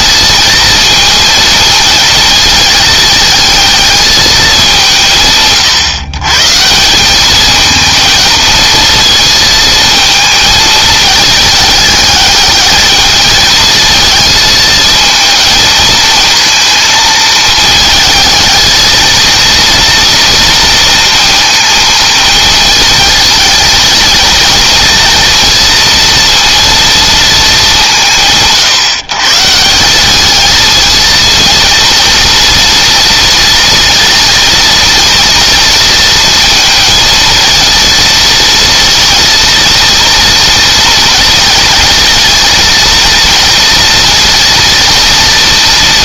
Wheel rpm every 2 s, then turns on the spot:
230, 220, 190, 150, 220, 220, 220, 220, 230, 220, 230, 220, 230, 230, 150, 220, 230, 230, 230, 230, 230, 230, 230.
none